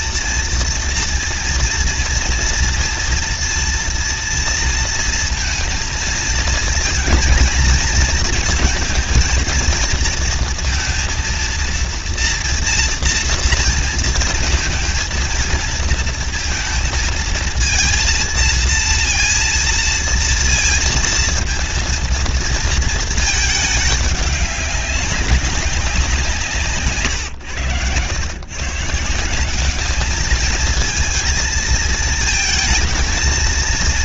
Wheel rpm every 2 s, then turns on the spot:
230, 230, 230, 230, 230, 230, 240, 230, 230, 230, 230, 230, 200, 160, 130, 220, 220.
none